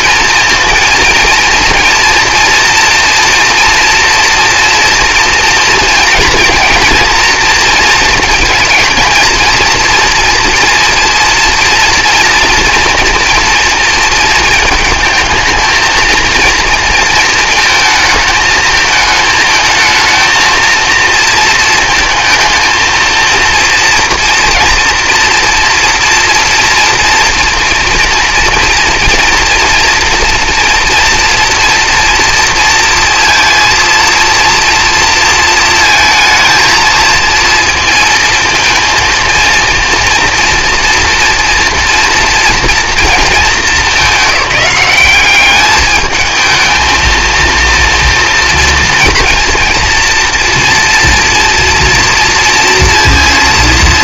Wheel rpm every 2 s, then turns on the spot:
230, 230, 230, 230, 230, 230, 230, 220, 230, 220, 230, 220, 230, 230, 240, 240, 230, 230, 220, 230, 230, 230, 200, 220, 230, 230, 230.
none